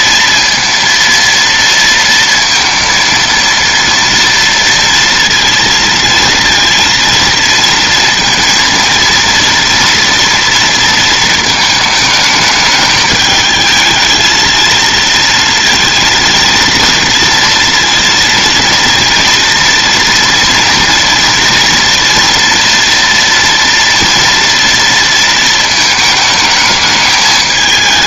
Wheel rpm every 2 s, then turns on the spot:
230, 230, 230, 230, 230, 230, 220, 220, 230, 230, 230, 230, 230, 220.
none